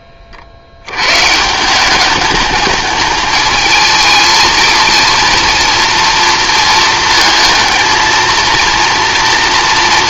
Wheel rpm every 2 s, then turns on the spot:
90, 210, 230, 230, 230.
none